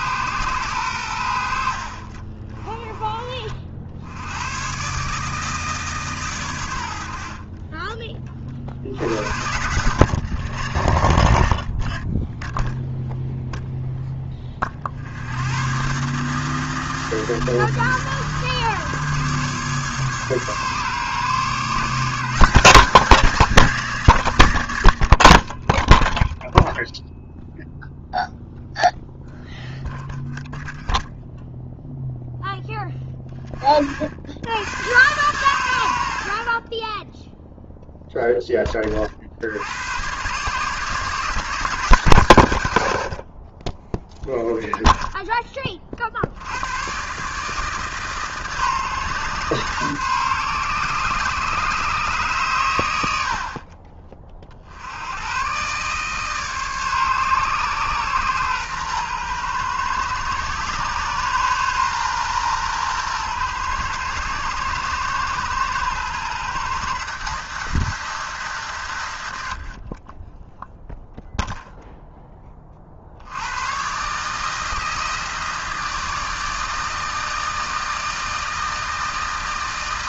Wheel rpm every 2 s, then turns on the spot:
100, 30, 130, 90, 70, 60, 0, 50, 160, 150, 140, 190, 70, 0, 0, 0, 10, 100, 10, 30, 150, 100, 0, 120, 140, 130, 100, 80, 140, 120, 130, 120, 120, 150, 140, 0, 50, 160, 160, 160.
none